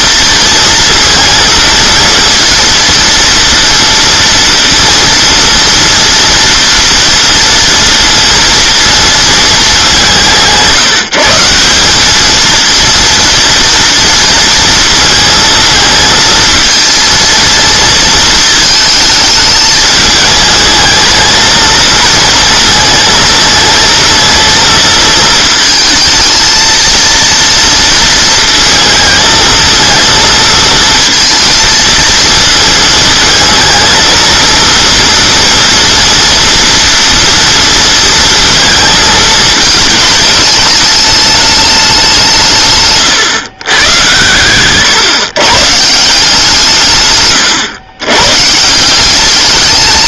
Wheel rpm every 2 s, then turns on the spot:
230, 230, 230, 240, 230, 160, 230, 230, 230, 220, 220, 230, 220, 230, 220, 220, 220, 230, 230, 220, 210, 140, 120, 150, 160.
42-44